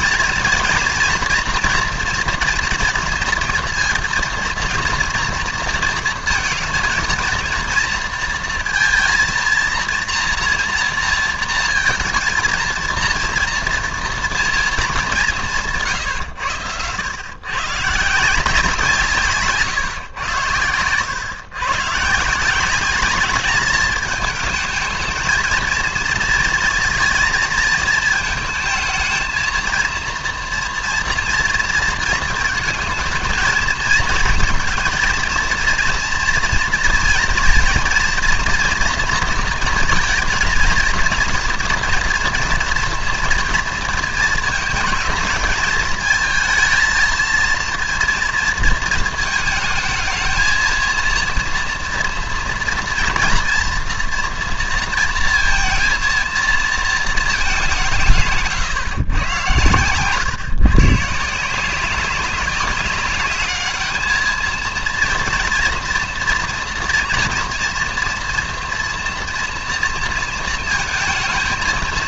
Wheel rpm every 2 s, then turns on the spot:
230, 230, 240, 230, 230, 230, 230, 230, 100, 170, 100, 180, 220, 230, 220, 230, 230, 230, 230, 230, 230, 230, 220, 220, 230, 230, 230, 230, 230, 140, 130, 200, 230, 230, 230, 230.
none